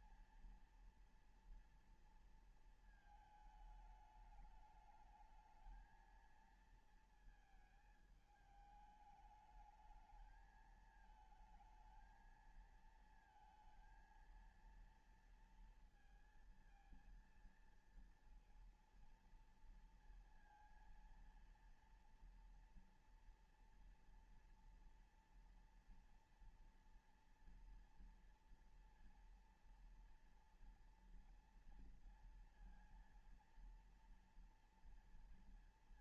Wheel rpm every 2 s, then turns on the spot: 230, 230, 210, 220, 210, 220, 220, 230, 230, 230, 230, 230, 230, 230, 230, 230, 230, 230.
none